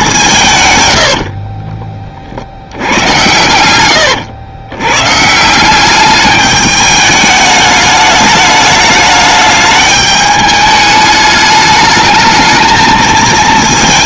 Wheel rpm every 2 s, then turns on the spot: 130, 60, 100, 210, 210, 210, 230.
none